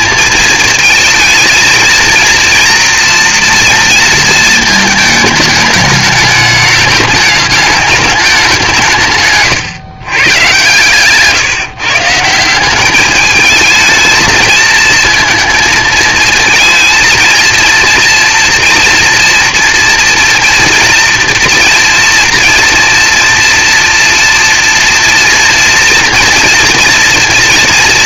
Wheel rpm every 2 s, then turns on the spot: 230, 230, 220, 210, 180, 130, 180, 220, 230, 230, 230, 230, 230, 240.
none